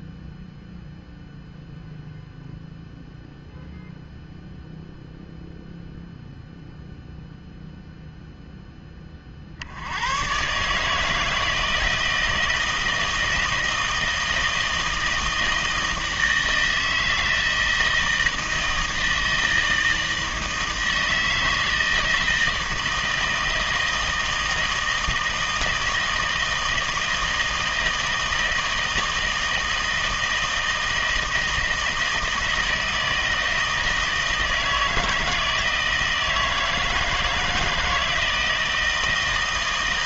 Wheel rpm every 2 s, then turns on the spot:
0, 0, 0, 0, 10, 150, 160, 160, 160, 160, 160, 160, 160, 160, 160, 160, 160, 160, 160, 160.
none